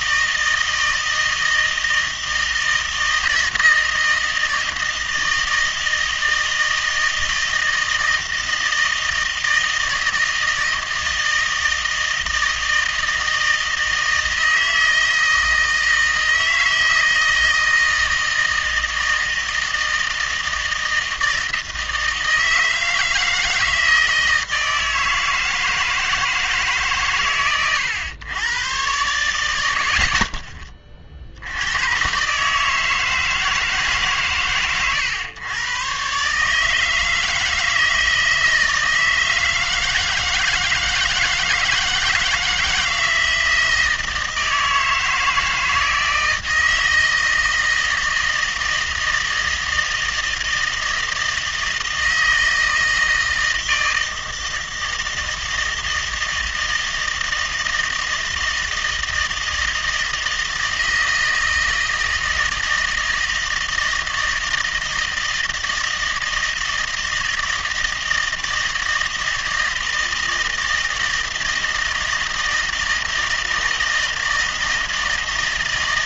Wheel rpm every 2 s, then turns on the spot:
160, 160, 160, 160, 160, 160, 160, 160, 160, 160, 160, 160, 160, 150, 110, 30, 150, 120, 150, 160, 160, 160, 160, 160, 160, 160, 160, 160, 160, 160, 160, 160, 160, 160, 160, 160, 160, 160.
none